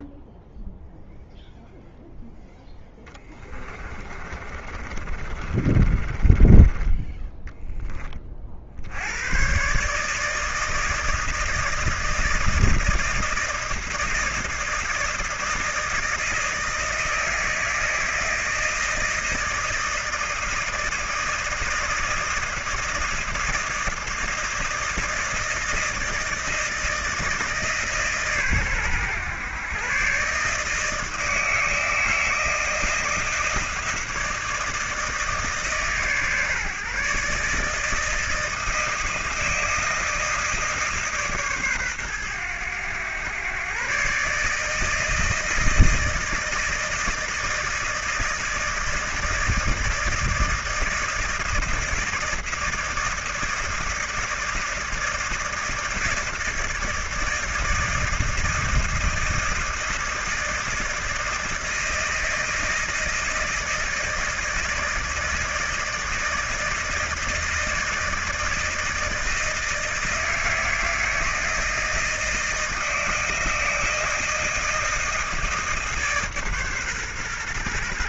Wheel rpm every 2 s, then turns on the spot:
0, 10, 30, 20, 40, 160, 160, 160, 160, 160, 160, 160, 160, 160, 130, 150, 160, 160, 140, 160, 160, 110, 150, 160, 160, 160, 160, 160, 160, 160, 160, 160, 160, 160, 160, 160, 160, 170, 140.
2-8